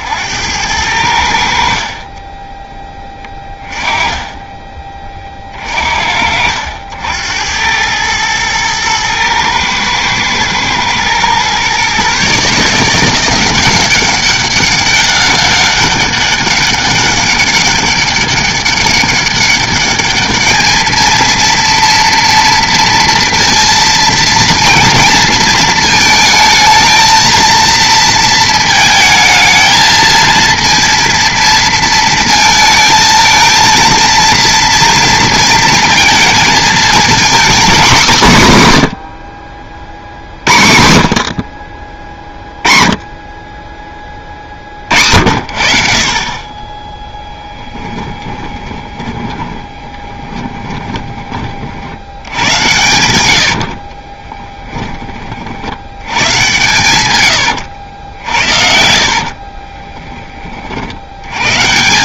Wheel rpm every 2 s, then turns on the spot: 90, 10, 20, 70, 110, 110, 160, 200, 200, 200, 220, 230, 230, 220, 220, 230, 230, 230, 230, 150, 70, 30, 50, 20, 20, 20, 100, 20, 120, 60, 60.
48-52 58-60